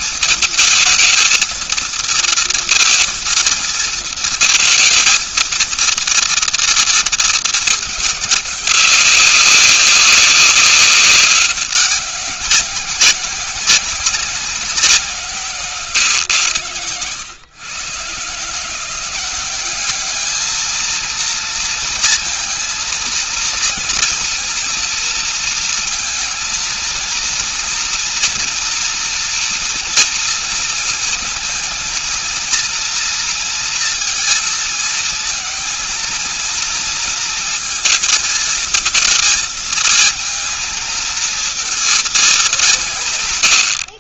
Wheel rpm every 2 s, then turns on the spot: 220, 220, 230, 230, 200, 200, 190, 190, 130, 160, 220, 230, 230, 230, 230, 230, 230, 230, 230, 230, 220, 210.
none